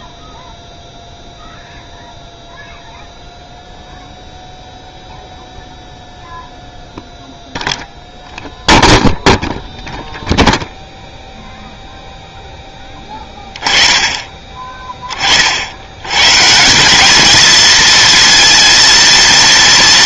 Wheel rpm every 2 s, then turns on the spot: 0, 0, 0, 0, 0, 0, 10, 20, 160, 230.
none